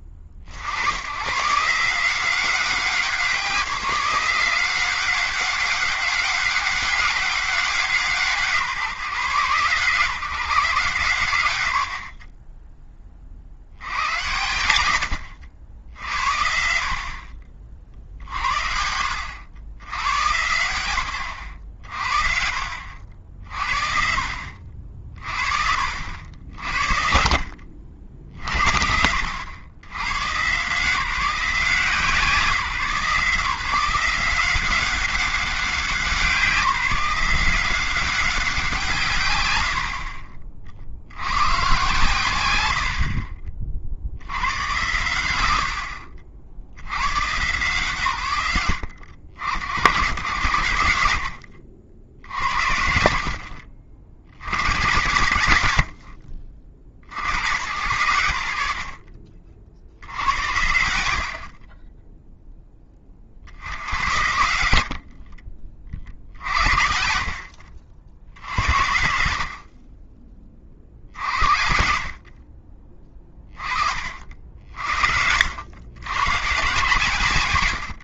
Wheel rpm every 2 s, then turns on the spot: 60, 190, 180, 200, 160, 140, 20, 90, 60, 70, 110, 60, 50, 60, 60, 150, 160, 190, 180, 190, 50, 100, 110, 60, 100, 100, 80, 90, 40, 80, 80, 10, 80, 70, 70, 40, 40, 50, 120.
54-56 64-68 74-76